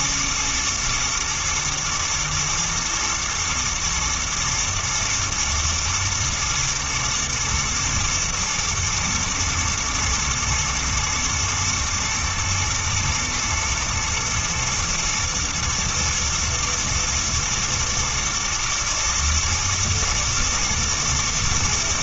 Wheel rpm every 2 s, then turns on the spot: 110, 120, 120, 120, 120, 110, 120, 110, 110, 110, 110.
none